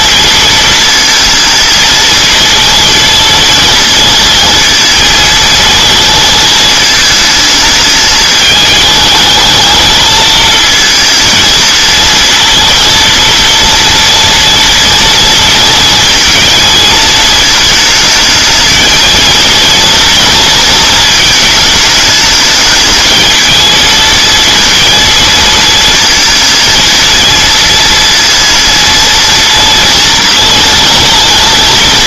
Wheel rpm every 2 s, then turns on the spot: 230, 230, 220, 220, 220, 230, 230, 230, 220, 220, 220, 220, 230, 230, 230, 230.
none